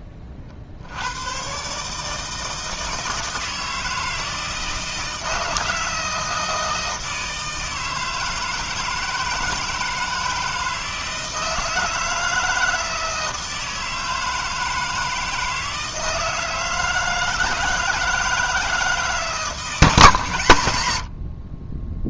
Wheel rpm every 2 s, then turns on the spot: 50, 160, 160, 160, 160, 160, 160, 160, 160, 160, 110.
none